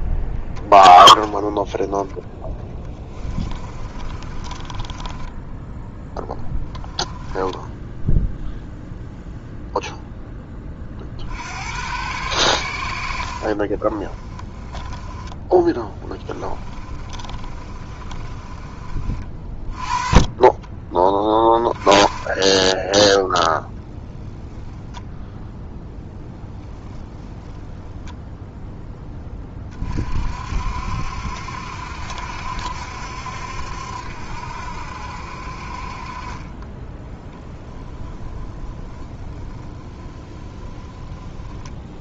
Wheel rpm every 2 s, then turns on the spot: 10, 10, 20, 10, 0, 50, 80, 20, 30, 30, 20, 0, 0, 10, 10, 60, 70, 60, 10, 10, 10.
2-8 12-18 26-28 36-42